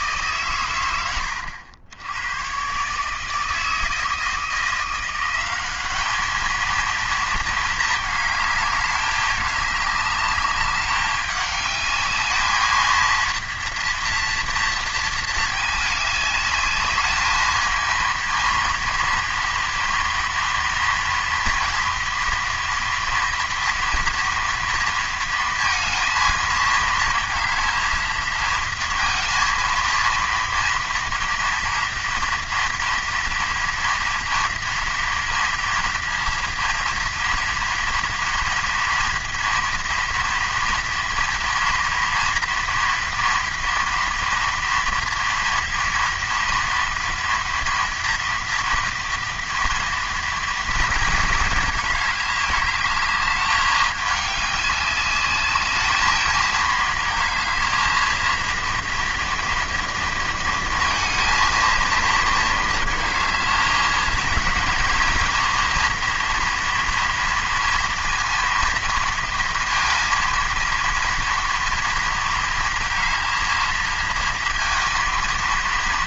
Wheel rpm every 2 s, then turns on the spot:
130, 120, 170, 230, 210, 200, 220, 230, 210, 230, 230, 230, 230, 220, 230, 230, 230, 230, 230, 230, 230, 230, 230, 230, 230, 230, 210, 200, 220, 230, 230, 220, 220, 230, 230, 230, 230, 220.
none